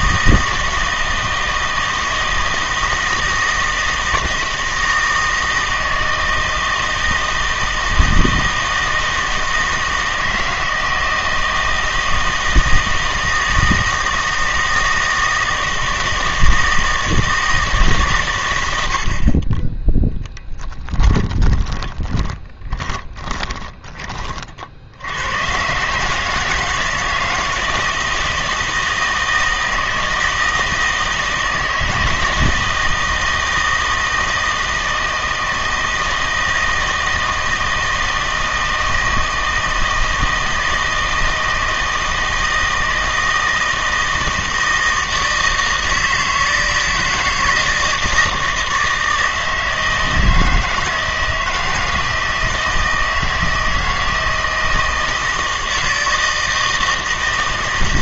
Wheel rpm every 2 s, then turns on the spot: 160, 160, 160, 160, 160, 160, 160, 160, 160, 90, 10, 20, 40, 160, 160, 160, 160, 160, 160, 160, 160, 160, 160, 160, 160, 160, 160, 160, 160.
20-24